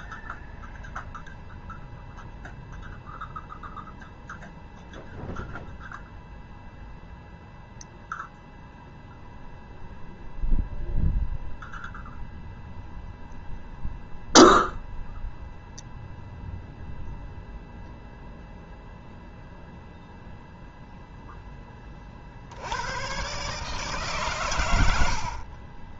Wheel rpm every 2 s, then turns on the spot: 0, 0, 0, 0, 0, 0, 0, 0, 0, 0, 0, 90, 100.
24-26